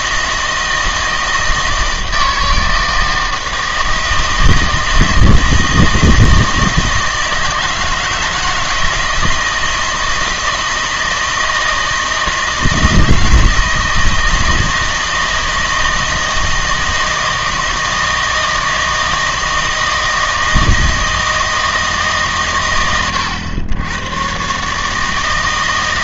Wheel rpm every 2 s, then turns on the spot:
160, 160, 160, 160, 160, 160, 160, 160, 160, 160, 160, 120, 150.
none